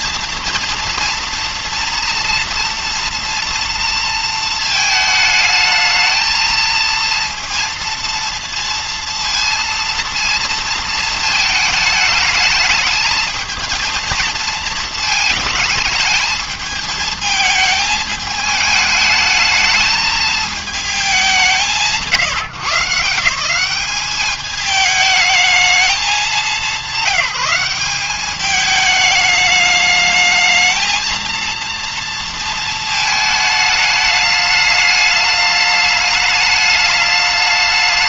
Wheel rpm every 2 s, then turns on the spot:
230, 230, 220, 230, 230, 230, 220, 220, 220, 210, 220, 150, 210, 190, 210, 220, 230, 210, 210.
none